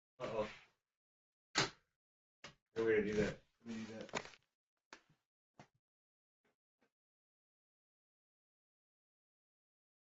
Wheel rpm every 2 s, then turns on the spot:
0, 0, 0, 0, 0.
none